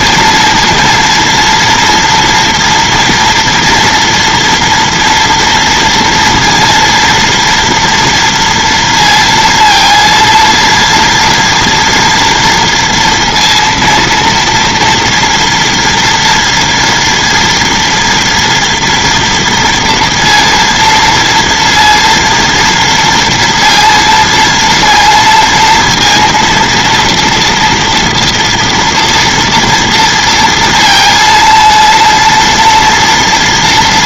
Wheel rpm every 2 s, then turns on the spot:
230, 240, 230, 230, 230, 230, 230, 230, 240, 230, 230, 240, 230, 230, 240, 230, 230.
none